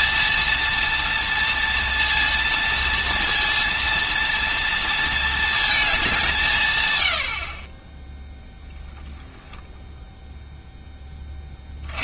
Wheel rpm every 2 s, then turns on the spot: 230, 230, 230, 130, 0, 0.
none